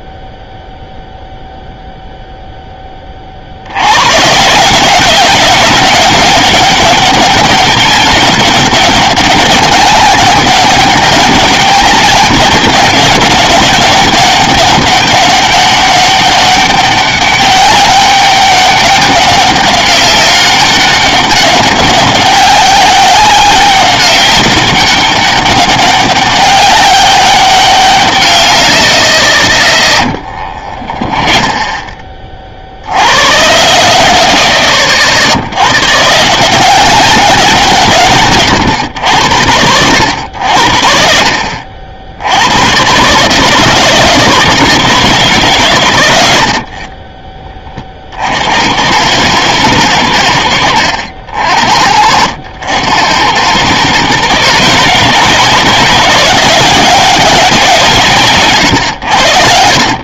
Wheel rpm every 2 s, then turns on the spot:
0, 0, 160, 200, 200, 200, 200, 190, 200, 200, 190, 200, 200, 200, 150, 30, 50, 100, 180, 130, 70, 100, 160, 60, 80, 80, 80, 140, 190, 120.
30-32 50-52